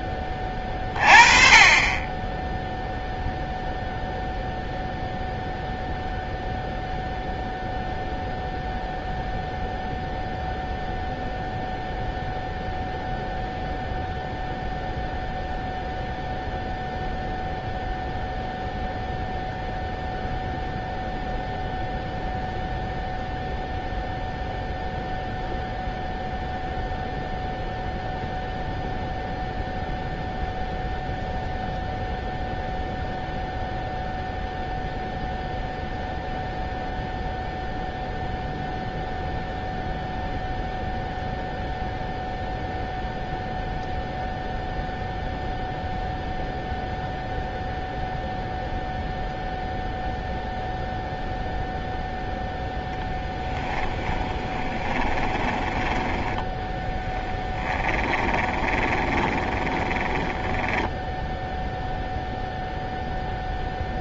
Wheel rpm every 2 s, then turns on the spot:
20, 10, 0, 0, 0, 0, 0, 0, 0, 0, 0, 0, 0, 0, 0, 0, 0, 0, 0, 0, 0, 0, 0, 0, 0, 0, 0, 20, 10, 20, 10, 0.
54-62